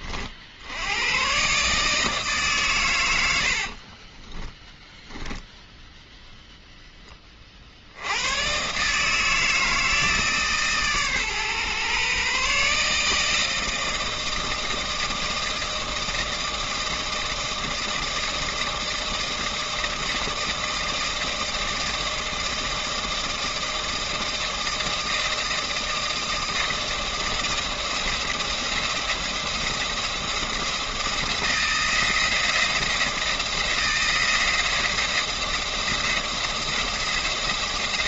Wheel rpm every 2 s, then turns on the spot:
70, 140, 10, 0, 120, 150, 140, 160, 160, 160, 160, 160, 160, 160, 170, 170, 170, 170, 170.
none